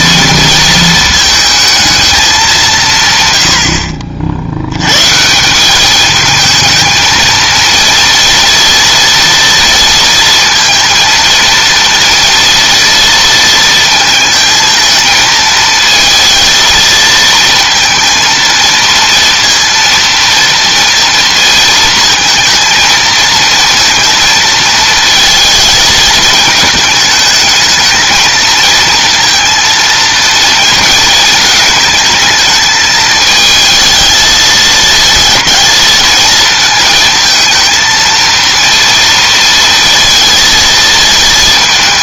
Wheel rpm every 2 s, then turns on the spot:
220, 180, 90, 220, 230, 230, 230, 220, 230, 230, 230, 230, 230, 220, 230, 230, 220, 220, 220, 230, 230.
none